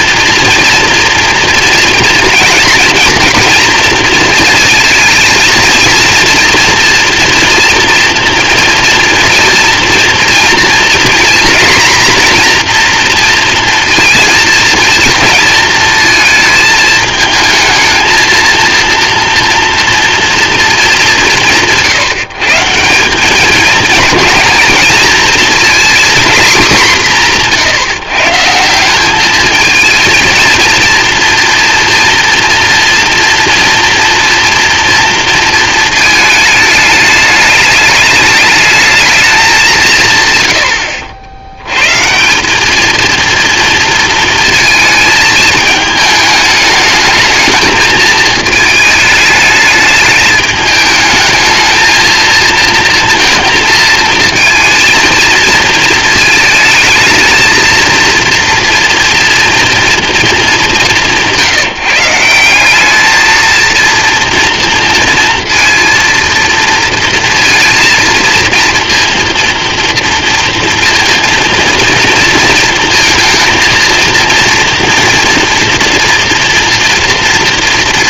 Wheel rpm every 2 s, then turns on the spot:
230, 240, 230, 230, 230, 240, 230, 230, 220, 230, 180, 200, 230, 170, 200, 230, 230, 230, 210, 210, 70, 230, 220, 220, 210, 220, 230, 230, 220, 240, 170, 220, 230, 230, 230, 230, 230, 230, 230.
none